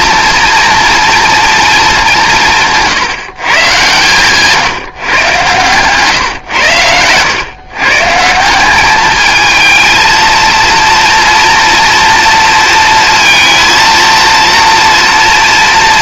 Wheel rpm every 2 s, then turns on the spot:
240, 160, 150, 110, 200, 230, 230, 240.
none